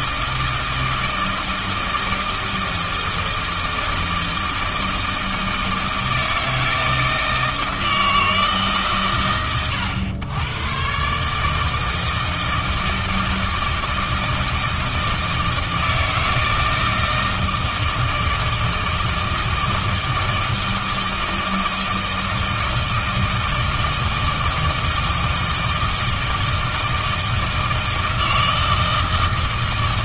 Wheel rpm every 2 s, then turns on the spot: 160, 160, 160, 160, 120, 120, 160, 160, 160, 160, 160, 160, 160, 160, 160.
none